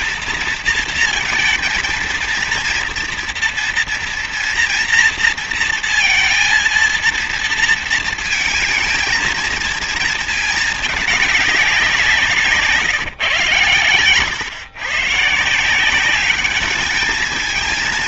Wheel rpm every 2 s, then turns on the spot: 230, 230, 230, 230, 230, 220, 150, 130, 210.
none